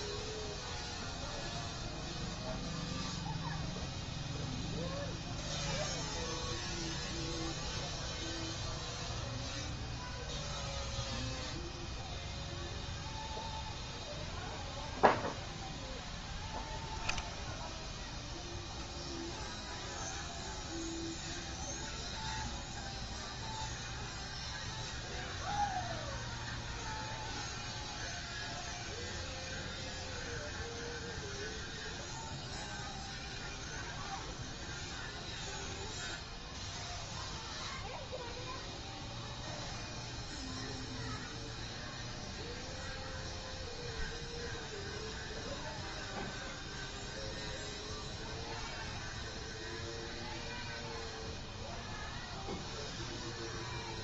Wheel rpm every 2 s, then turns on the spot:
0, 0, 0, 0, 0, 0, 0, 0, 0, 0, 0, 0, 0, 0, 0, 0, 0, 0, 0, 0, 0, 0, 0, 0, 0, 0, 0.
none